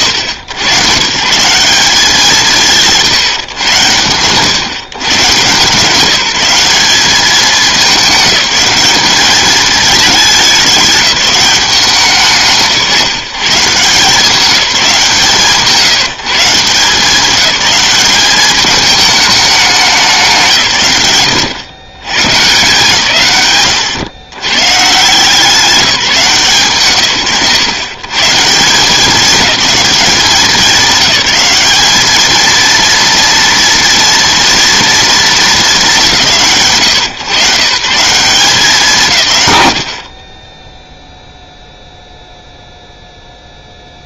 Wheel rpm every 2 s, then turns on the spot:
120, 160, 130, 200, 200, 200, 150, 190, 170, 210, 180, 150, 150, 140, 170, 190, 220, 230, 110, 190, 20, 0.
none